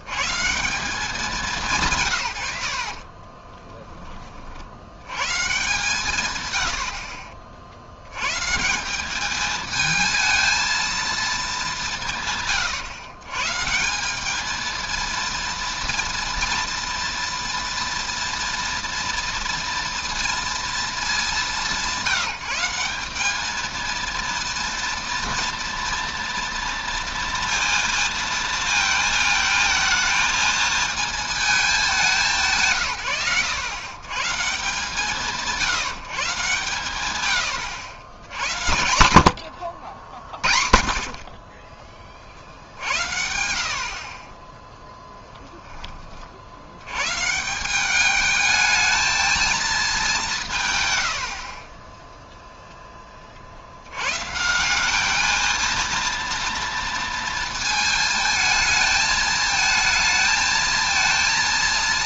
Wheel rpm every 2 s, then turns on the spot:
160, 70, 60, 100, 160, 230, 130, 220, 230, 230, 210, 180, 230, 240, 220, 220, 150, 160, 130, 100, 50, 60, 10, 80, 220, 130, 10, 180, 230, 220, 220.
44-46